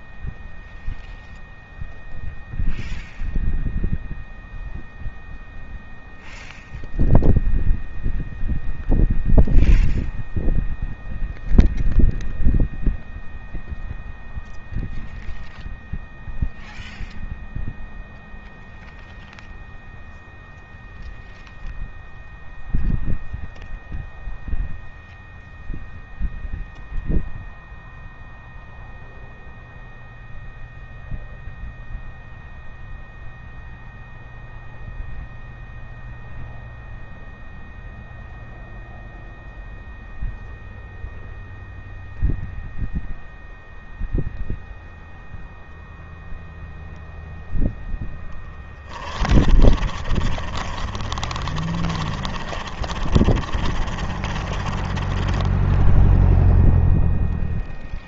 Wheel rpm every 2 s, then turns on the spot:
0, 0, 0, 0, 0, 0, 0, 0, 0, 0, 0, 0, 0, 0, 0, 0, 0, 0, 0, 0, 0, 0, 0, 0, 10, 30, 30, 30, 0.
48-56